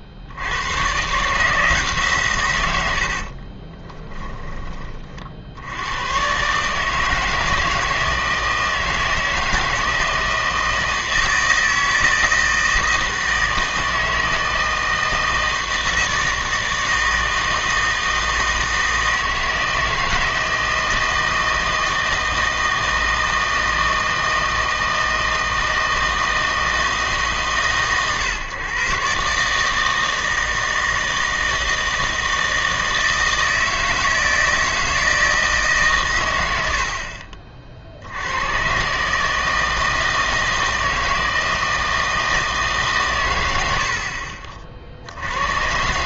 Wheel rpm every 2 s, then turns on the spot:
100, 100, 20, 140, 160, 160, 160, 160, 160, 160, 160, 160, 160, 160, 130, 160, 160, 160, 90, 110, 160, 150, 50.
none